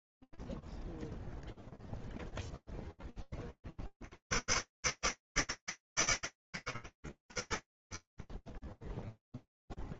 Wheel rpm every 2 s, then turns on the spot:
20, 0, 40, 140, 30.
none